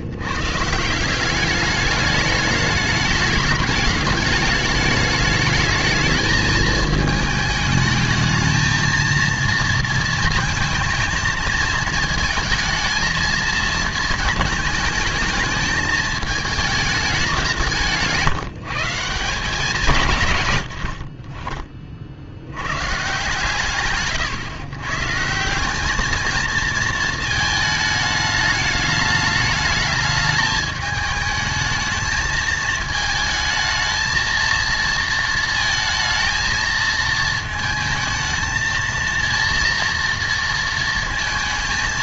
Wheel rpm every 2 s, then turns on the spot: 120, 210, 210, 220, 220, 230, 230, 220, 220, 170, 120, 60, 140, 220, 210, 210, 220, 230, 220, 220, 230.
none